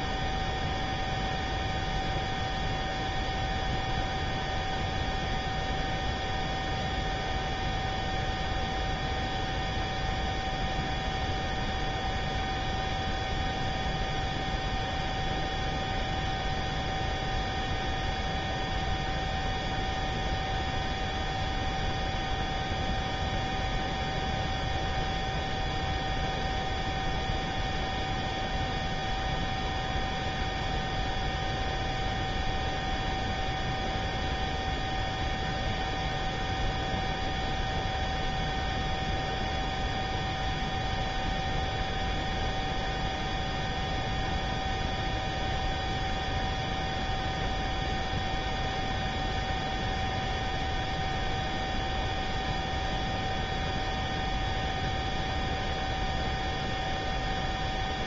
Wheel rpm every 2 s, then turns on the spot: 0, 0, 0, 0, 0, 0, 0, 0, 0, 0, 0, 0, 0, 0, 0, 0, 0, 0, 0, 0, 0, 0, 0, 0, 0, 0, 0, 0, 0.
none